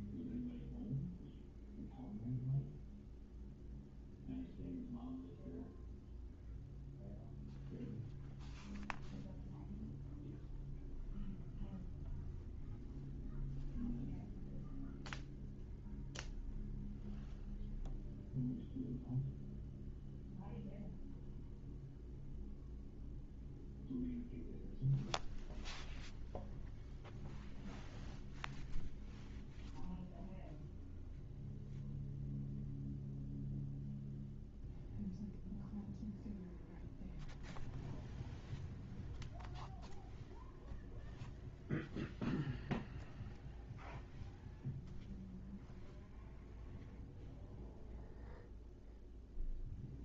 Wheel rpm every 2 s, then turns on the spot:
0, 0, 0, 0, 0, 0, 0, 0, 0, 0, 0, 0, 0, 0, 0, 0, 0, 0, 0, 0, 0, 0, 0, 0, 0.
none